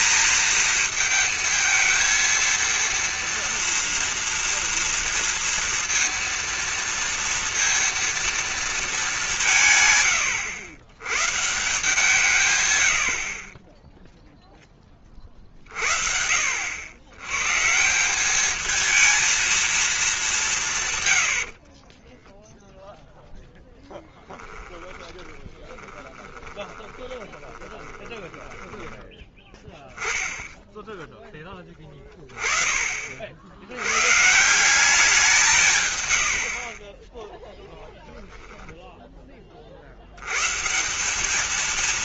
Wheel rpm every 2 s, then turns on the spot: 230, 230, 230, 230, 220, 100, 120, 10, 70, 210, 190, 0, 10, 20, 20, 10, 30, 170, 50, 10, 120.
24-30